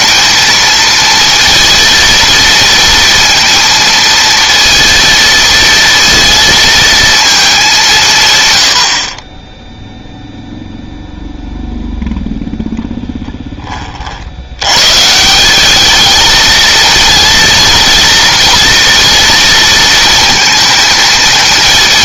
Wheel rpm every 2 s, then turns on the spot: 230, 230, 230, 230, 70, 0, 10, 130, 220, 230, 220.
none